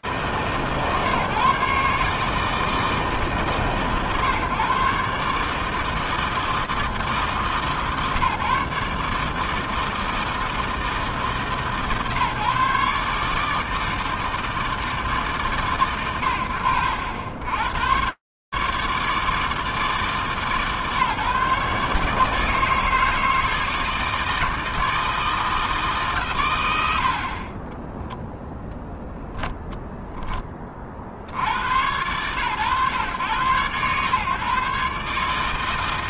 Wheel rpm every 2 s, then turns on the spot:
150, 150, 140, 160, 150, 160, 150, 160, 70, 140, 150, 160, 160, 100, 0, 10, 110, 130.
none